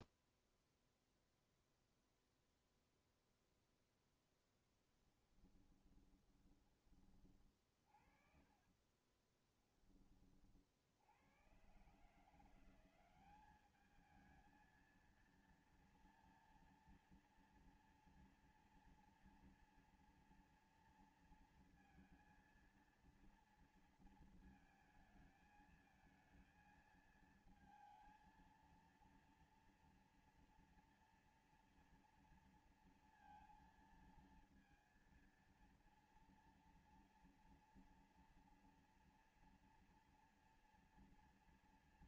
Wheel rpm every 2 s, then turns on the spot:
0, 0, 20, 20, 40, 40, 170, 220, 240, 230, 230, 230, 220, 220, 230, 240, 230, 230, 230, 230, 230.
4-6 8-10